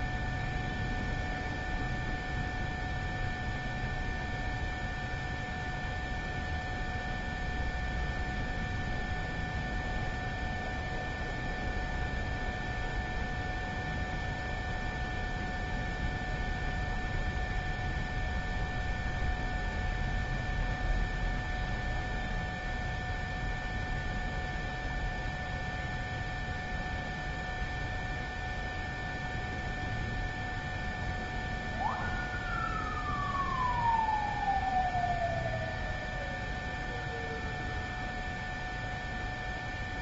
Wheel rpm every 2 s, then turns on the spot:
0, 0, 0, 0, 0, 0, 0, 0, 0, 0, 0, 0, 0, 0, 0, 0, 0, 0, 0, 0.
none